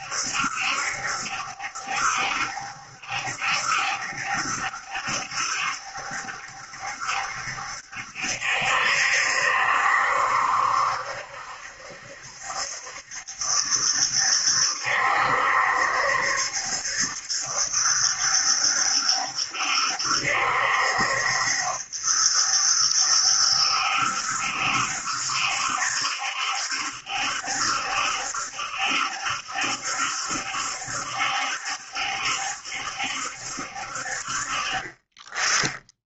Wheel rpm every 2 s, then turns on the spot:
70, 70, 70, 70, 70, 70, 70, 70, 70, 70, 70, 70, 70, 70, 70, 70, 70, 40.
none